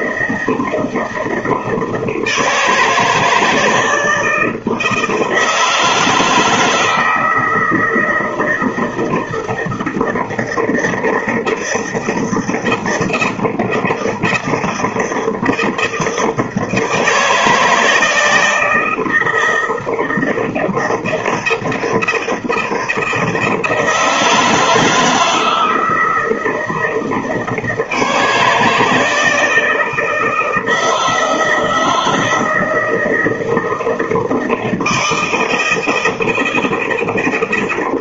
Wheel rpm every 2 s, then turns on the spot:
160, 160, 160, 160, 160, 160, 160, 160, 160, 160, 170, 160, 160, 160, 160, 160, 160, 160, 160.
none